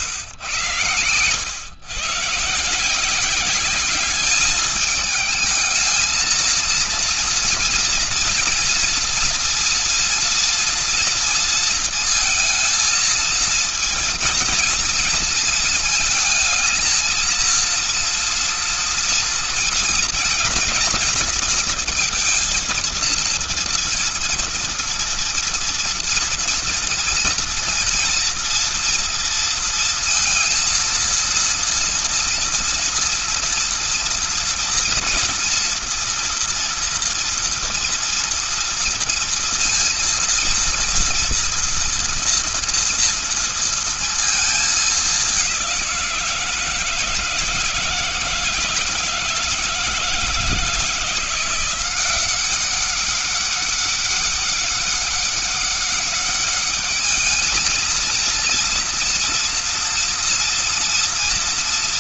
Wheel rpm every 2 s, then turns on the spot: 110, 160, 210, 230, 230, 230, 230, 230, 230, 230, 230, 230, 230, 230, 230, 230, 230, 230, 230, 230, 230, 230, 210, 160, 160, 160, 190, 200, 210, 230, 230.
none